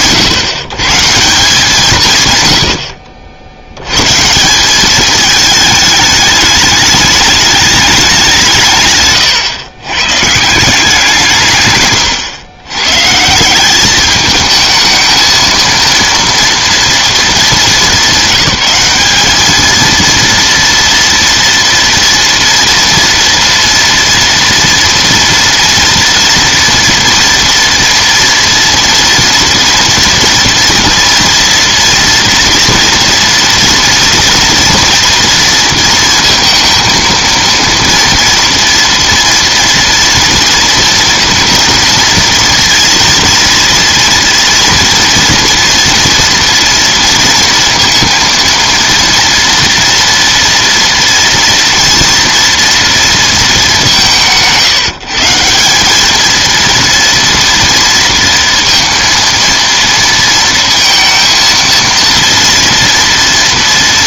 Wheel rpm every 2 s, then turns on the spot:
130, 110, 180, 210, 170, 160, 120, 220, 230, 200, 230, 230, 230, 230, 230, 230, 230, 230, 230, 230, 230, 230, 230, 230, 230, 230, 230, 130, 220, 230, 230, 230.
none